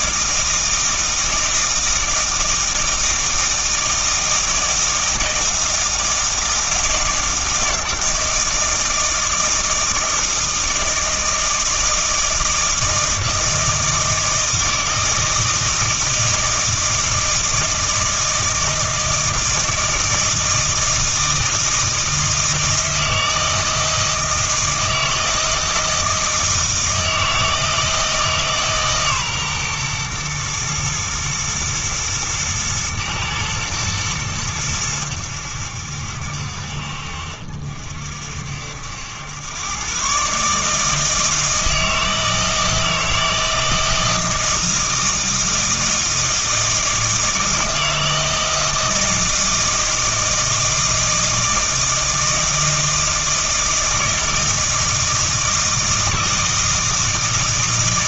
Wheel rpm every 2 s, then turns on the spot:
160, 160, 160, 160, 160, 160, 160, 160, 160, 160, 160, 160, 160, 160, 140, 120, 110, 100, 60, 70, 150, 160, 160, 160, 160, 160, 160, 160, 160.
none